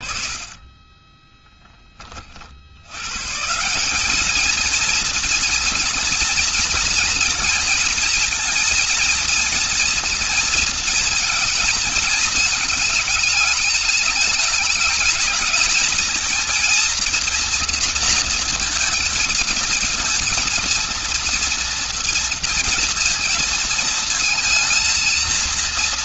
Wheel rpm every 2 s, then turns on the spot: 30, 70, 220, 230, 230, 220, 210, 210, 230, 230, 230, 230, 230.
none